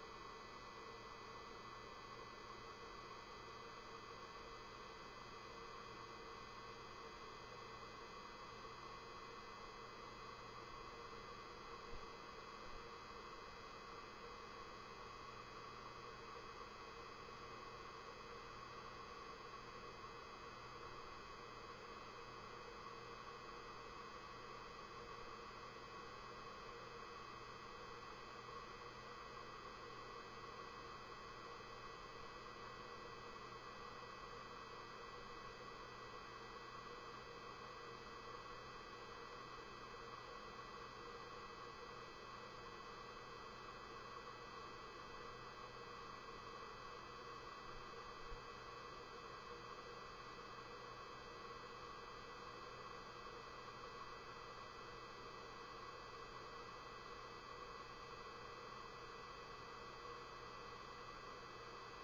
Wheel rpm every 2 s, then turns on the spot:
0, 0, 0, 0, 0, 0, 0, 0, 0, 0, 0, 0, 0, 0, 0, 0, 0, 0, 0, 0, 0, 0, 0, 0, 0, 0, 0, 0, 0, 0, 0.
none